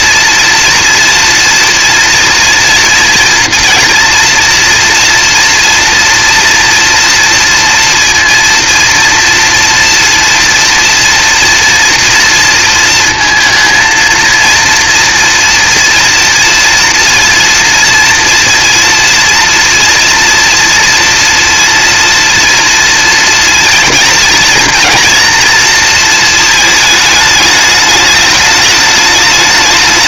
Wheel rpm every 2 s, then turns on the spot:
230, 230, 230, 230, 230, 230, 230, 240, 230, 230, 230, 230, 230, 220, 210.
none